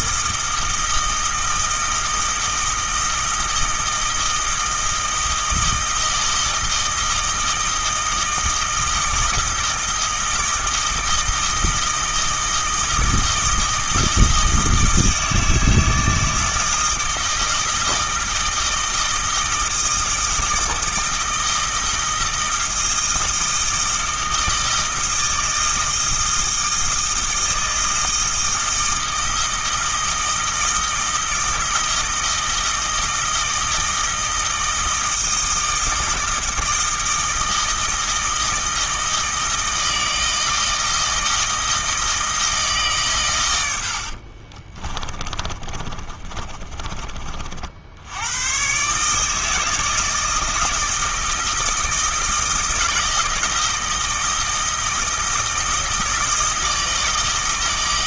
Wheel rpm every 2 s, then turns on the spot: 160, 160, 160, 160, 160, 160, 160, 160, 160, 160, 160, 160, 160, 160, 160, 160, 160, 160, 160, 160, 160, 150, 30, 30, 130, 160, 160, 160, 160.
44-48